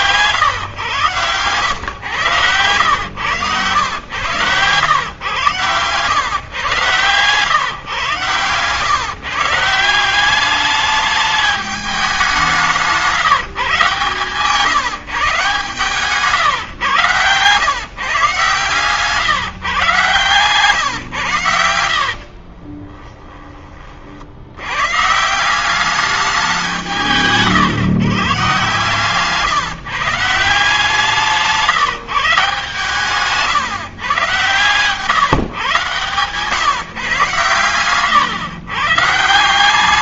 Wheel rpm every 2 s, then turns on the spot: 120, 110, 120, 120, 140, 200, 190, 150, 140, 130, 140, 40, 90, 190, 130, 160, 160, 120, 130, 130.
12-14 22-24